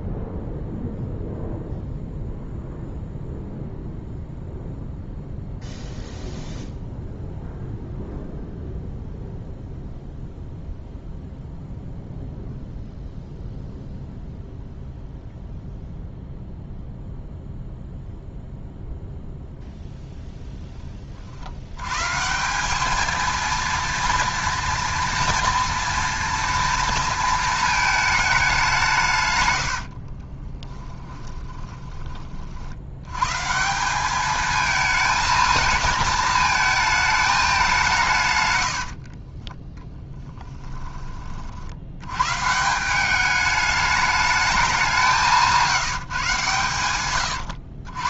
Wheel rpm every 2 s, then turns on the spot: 0, 0, 0, 0, 0, 0, 0, 0, 0, 0, 30, 220, 230, 230, 160, 20, 90, 220, 220, 70, 20, 180, 180, 120.
30-32 38-40